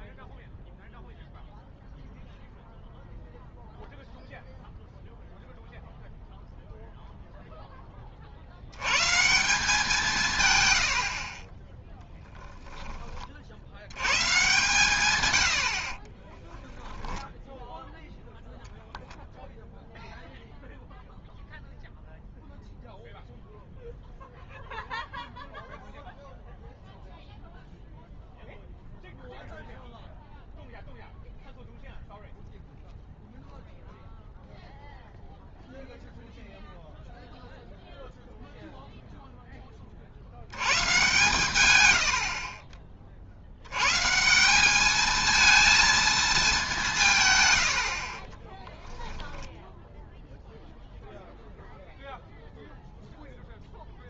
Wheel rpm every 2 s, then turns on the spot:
0, 0, 0, 0, 80, 110, 10, 150, 10, 0, 0, 0, 0, 0, 0, 0, 0, 0, 0, 0, 110, 40, 190, 200, 10, 0, 0.
16-18 48-50